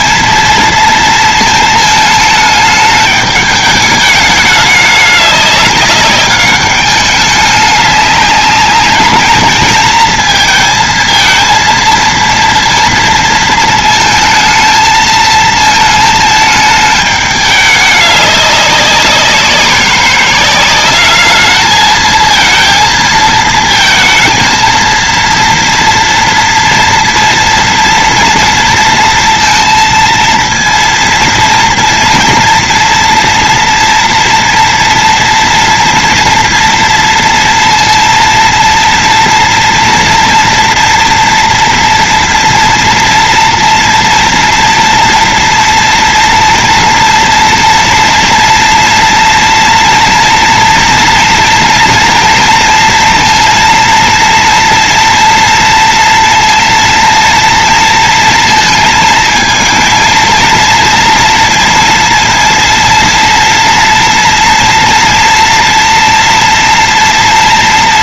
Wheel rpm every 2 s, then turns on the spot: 230, 210, 210, 200, 200, 230, 230, 230, 220, 200, 190, 230, 230, 230, 230, 230, 230, 230, 230, 230, 230, 230, 240, 240, 230, 230, 230, 230, 230, 230, 230, 230, 230, 230.
none